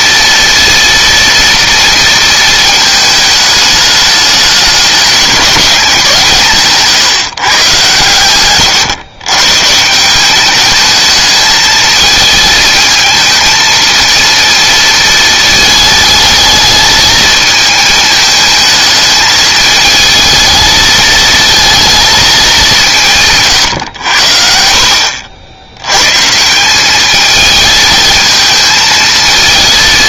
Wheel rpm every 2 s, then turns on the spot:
230, 220, 210, 150, 120, 210, 220, 230, 220, 220, 220, 180, 60, 190, 220.
none